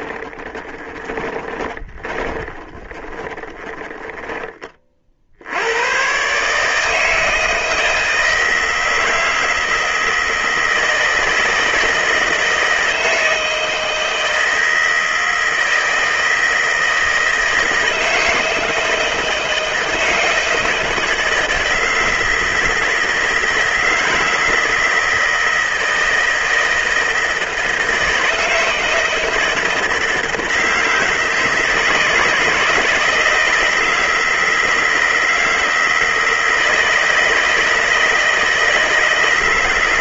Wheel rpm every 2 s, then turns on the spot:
20, 20, 50, 160, 160, 160, 160, 160, 160, 160, 160, 160, 160, 160, 160, 160, 160, 160, 160, 160.
0-4